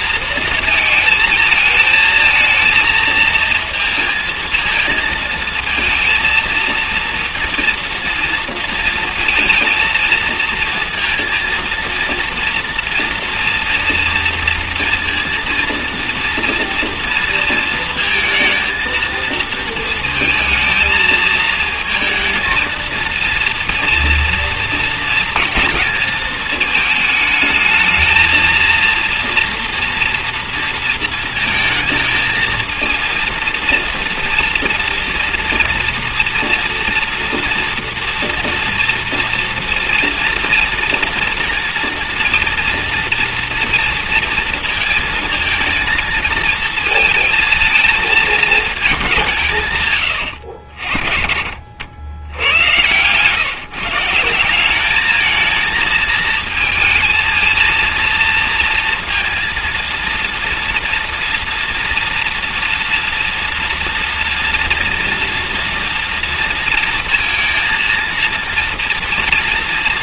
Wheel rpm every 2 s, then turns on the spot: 230, 220, 230, 230, 230, 230, 230, 230, 230, 230, 220, 230, 230, 220, 230, 230, 230, 230, 240, 240, 230, 230, 220, 230, 210, 70, 100, 190, 220, 230, 230, 230, 240, 230, 230.
none